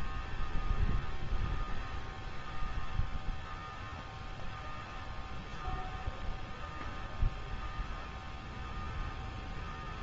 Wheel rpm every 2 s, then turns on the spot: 0, 0, 0, 0, 0.
none